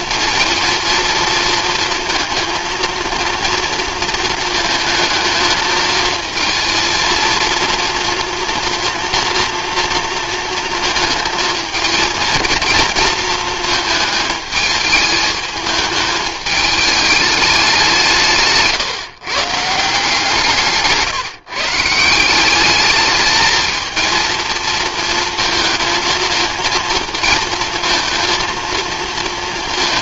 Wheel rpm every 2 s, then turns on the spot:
230, 230, 230, 220, 230, 230, 230, 220, 210, 160, 170, 180, 230, 220, 230.
none